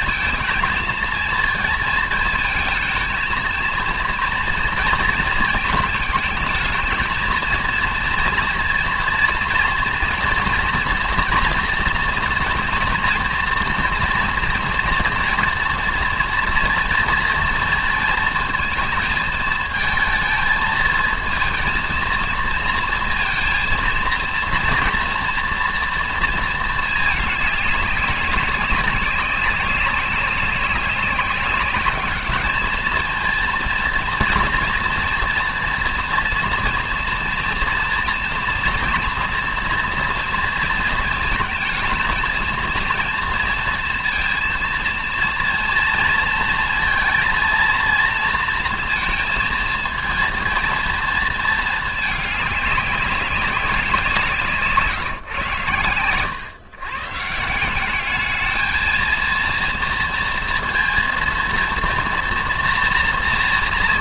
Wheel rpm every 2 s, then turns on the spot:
230, 230, 230, 220, 240, 230, 230, 240, 230, 220, 220, 230, 230, 220, 200, 190, 220, 230, 230, 240, 230, 230, 230, 230, 230, 230, 200, 150, 140, 220, 230, 240.
none